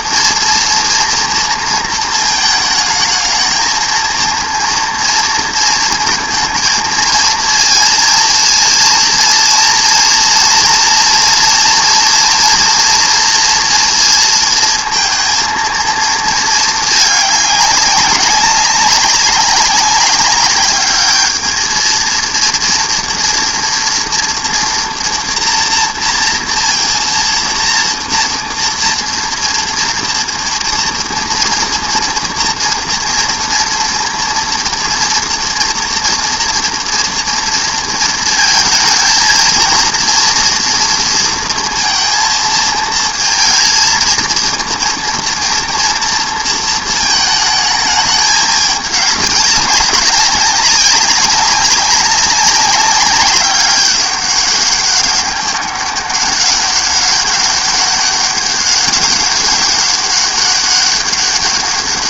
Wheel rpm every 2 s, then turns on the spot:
230, 220, 230, 230, 230, 240, 230, 230, 220, 200, 210, 230, 230, 230, 230, 230, 230, 230, 230, 230, 230, 230, 230, 230, 200, 200, 200, 200, 200, 200, 200.
none